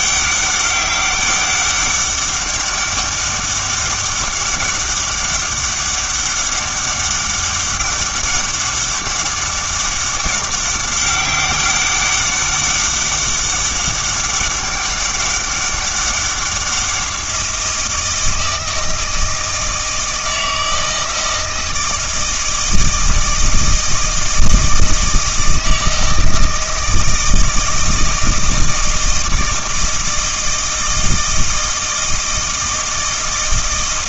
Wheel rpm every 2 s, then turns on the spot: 200, 200, 190, 200, 200, 200, 200, 200, 190, 160, 160, 160, 160, 160, 160, 160, 160.
none